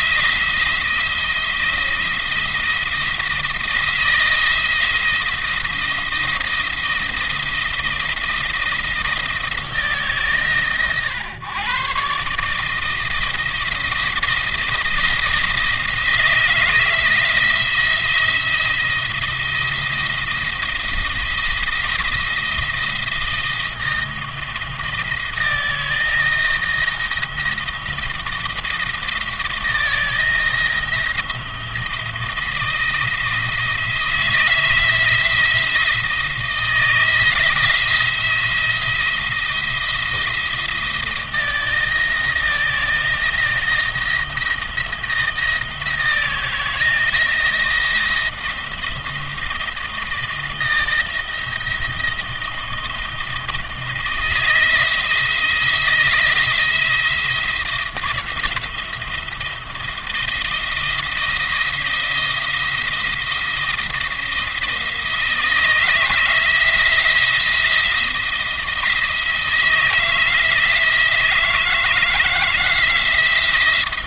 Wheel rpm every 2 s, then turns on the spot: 170, 170, 170, 170, 170, 130, 160, 160, 160, 170, 170, 170, 170, 170, 160, 160, 160, 160, 170, 170, 170, 170, 170, 160, 170, 170, 160, 160, 170, 170, 170, 170, 160, 160, 170, 160, 170.
none